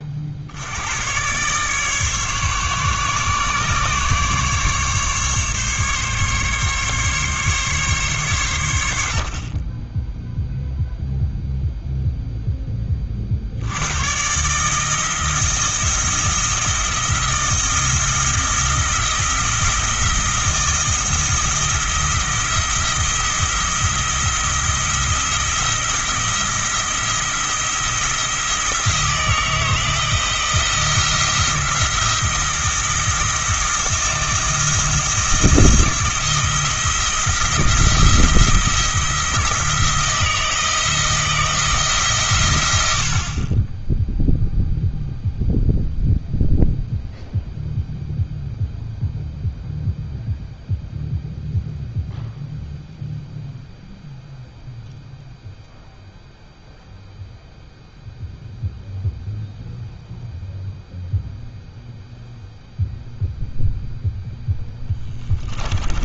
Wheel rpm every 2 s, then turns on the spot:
90, 140, 140, 140, 90, 0, 20, 160, 170, 170, 160, 170, 170, 170, 160, 170, 170, 160, 170, 170, 160, 80, 0, 0, 0, 0, 0, 0, 0, 0, 0, 0, 10.
64-66